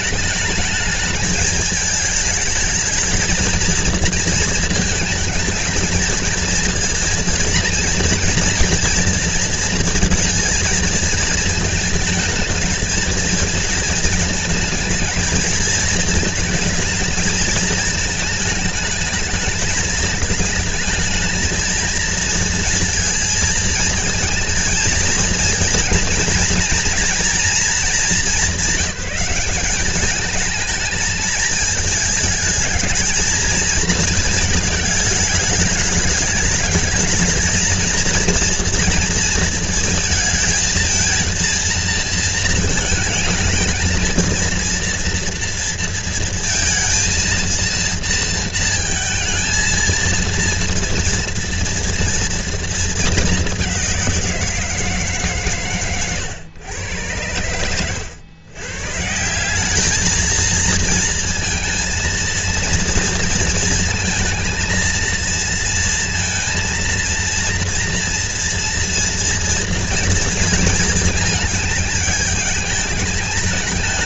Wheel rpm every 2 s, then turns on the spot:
210, 220, 220, 230, 230, 220, 220, 220, 220, 220, 220, 230, 230, 230, 190, 220, 220, 210, 210, 230, 230, 230, 230, 230, 220, 230, 230, 160, 110, 140, 230, 230, 230, 230, 230, 230, 210.
none